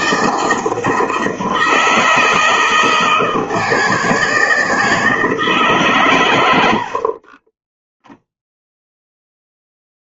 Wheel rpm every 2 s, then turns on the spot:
160, 160, 160, 90, 0.
none